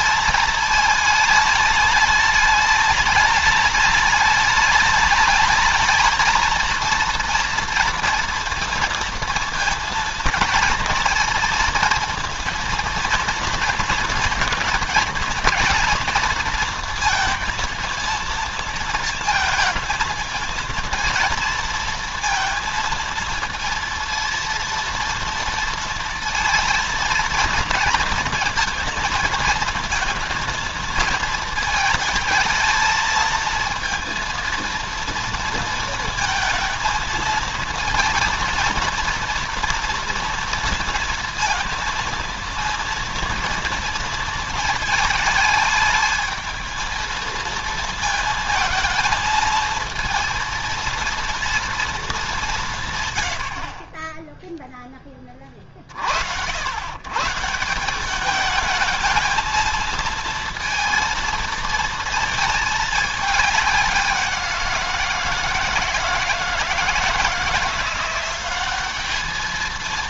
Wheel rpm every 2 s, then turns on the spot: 220, 210, 210, 230, 230, 230, 230, 230, 230, 230, 220, 230, 230, 230, 220, 230, 220, 230, 230, 230, 230, 230, 220, 220, 220, 230, 190, 0, 80, 210, 230, 220, 170, 160, 190.
none